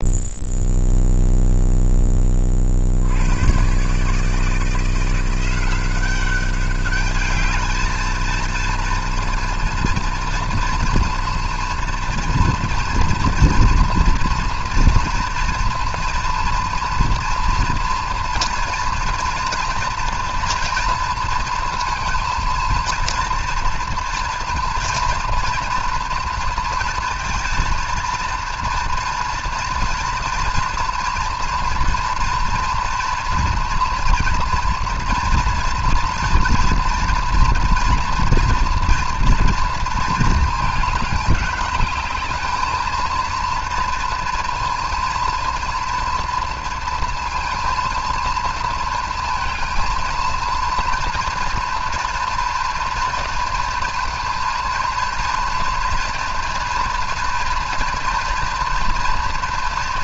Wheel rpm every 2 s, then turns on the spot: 0, 30, 160, 200, 230, 230, 230, 230, 240, 240, 240, 230, 230, 230, 230, 230, 230, 230, 240, 230, 220, 220, 230, 230, 230, 230, 230, 230, 230, 240.
none